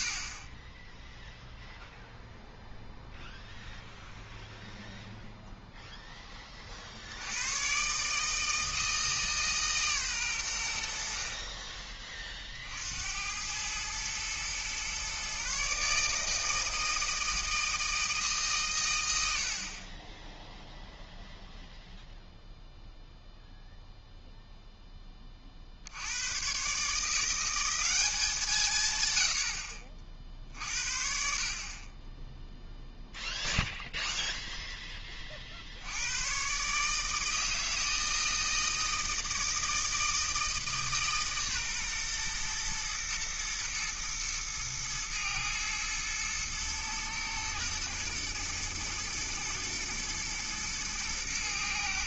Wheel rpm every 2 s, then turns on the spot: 20, 0, 0, 40, 160, 100, 60, 120, 160, 130, 0, 0, 0, 130, 160, 50, 0, 10, 140, 160, 160, 120, 110, 120, 110, 110.
none